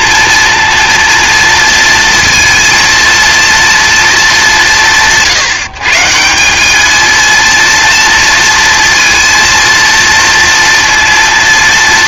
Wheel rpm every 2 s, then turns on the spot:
230, 230, 180, 200, 230, 230.
none